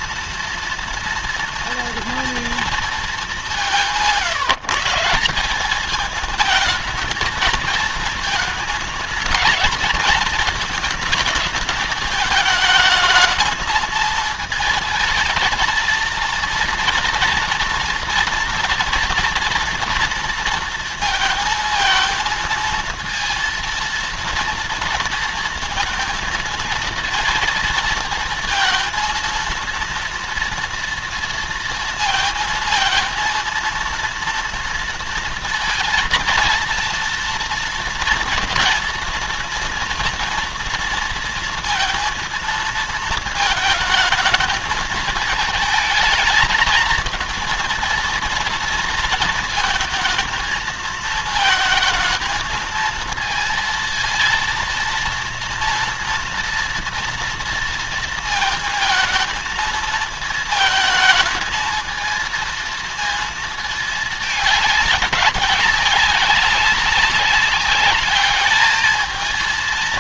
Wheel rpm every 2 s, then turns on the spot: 230, 230, 150, 220, 230, 220, 220, 220, 230, 230, 230, 230, 230, 230, 230, 230, 230, 230, 230, 230, 230, 230, 220, 230, 230, 220, 230, 230, 230, 230, 220, 230, 210, 190, 220.
none